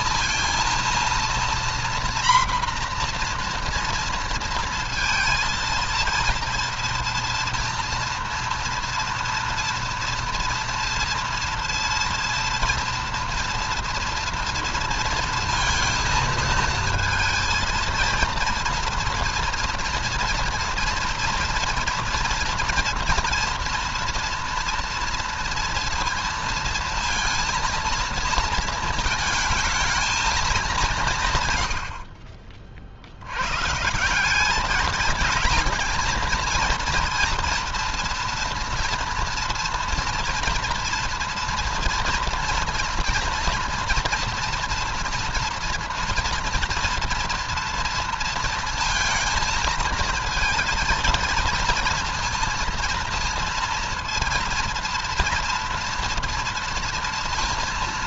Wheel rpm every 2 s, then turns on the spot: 230, 240, 230, 230, 230, 230, 230, 230, 230, 230, 230, 240, 230, 230, 220, 180, 60, 210, 230, 230, 230, 240, 240, 230, 230, 230, 230, 230, 230.
none